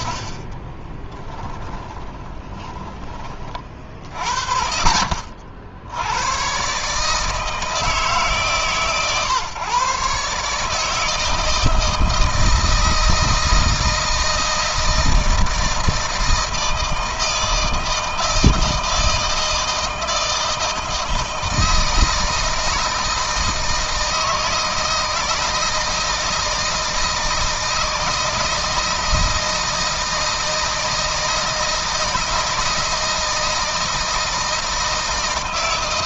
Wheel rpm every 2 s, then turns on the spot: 30, 20, 50, 130, 140, 150, 160, 160, 160, 160, 160, 160, 160, 160, 160, 160, 160, 160.
0-4